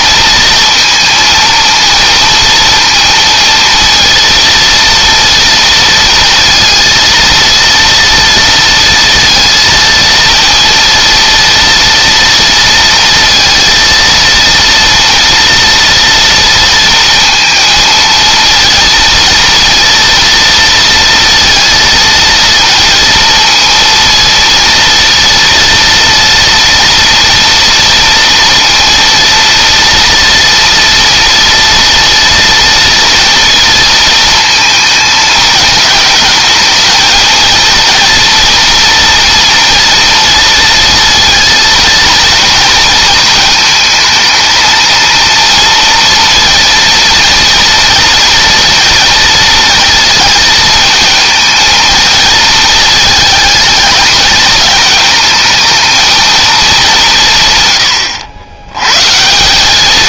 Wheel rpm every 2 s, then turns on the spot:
230, 230, 230, 230, 230, 230, 230, 240, 230, 230, 230, 230, 230, 230, 230, 230, 230, 220, 220, 230, 230, 220, 220, 230, 230, 230, 220, 220, 200, 120.
none